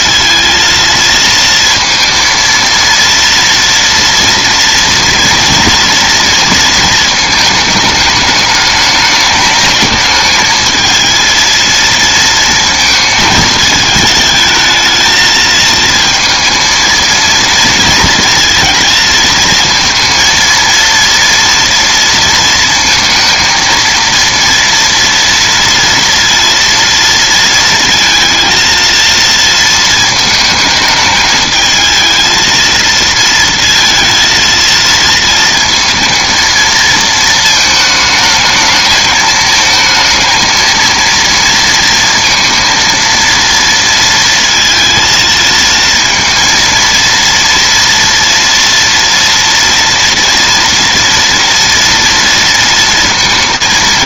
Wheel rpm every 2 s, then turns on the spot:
230, 230, 230, 220, 210, 220, 220, 220, 230, 230, 230, 230, 230, 230, 230, 210, 230, 230, 230, 220, 230, 230, 230, 230, 230, 230, 230.
none